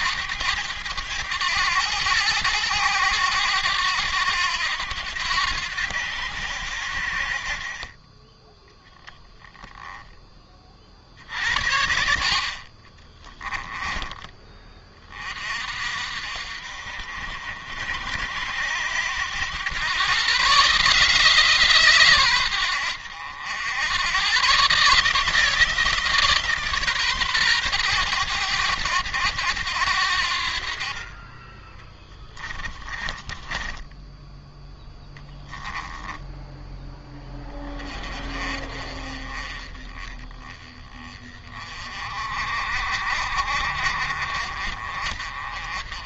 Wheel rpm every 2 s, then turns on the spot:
100, 100, 90, 70, 10, 30, 40, 30, 60, 80, 140, 100, 150, 140, 110, 50, 20, 10, 10, 40, 20, 50, 40.
12-14 32-34